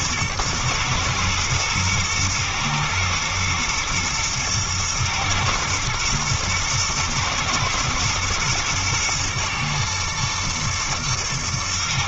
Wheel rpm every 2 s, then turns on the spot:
120, 120, 120, 110, 120, 110.
none